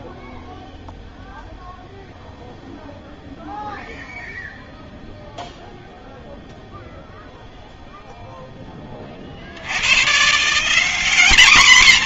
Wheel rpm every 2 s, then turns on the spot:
0, 0, 0, 0, 20, 210.
none